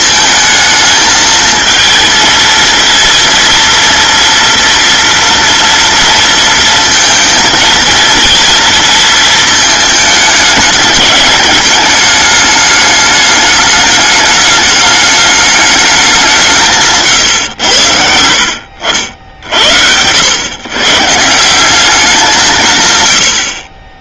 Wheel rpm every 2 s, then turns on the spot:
220, 230, 230, 230, 230, 220, 210, 210, 170, 70, 110, 170.
none